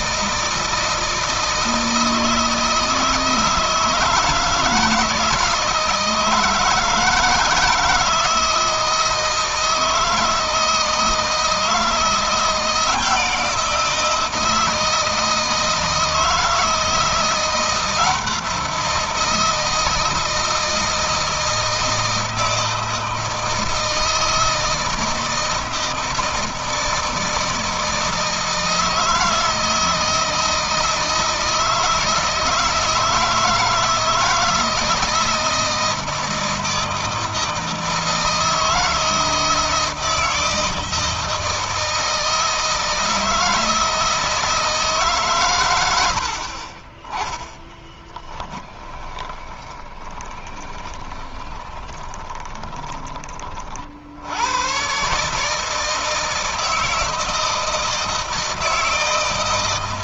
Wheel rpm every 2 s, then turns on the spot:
160, 160, 160, 160, 160, 160, 170, 160, 170, 170, 160, 160, 160, 160, 160, 160, 160, 160, 160, 160, 160, 170, 150, 30, 10, 20, 30, 130, 160, 160.
48-52